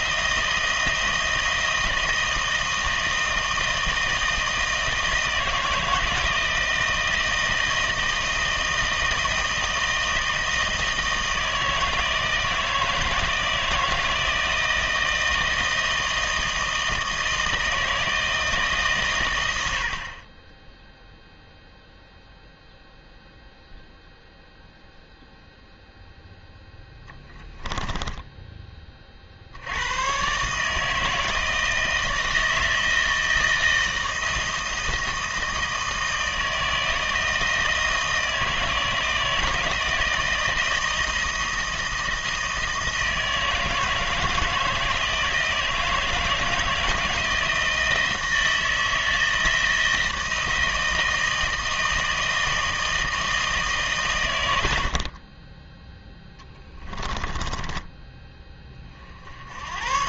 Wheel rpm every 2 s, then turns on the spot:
160, 160, 160, 160, 160, 160, 160, 160, 160, 150, 10, 0, 0, 0, 20, 160, 160, 160, 160, 160, 160, 160, 160, 160, 160, 160, 160, 80, 10, 30.
56-58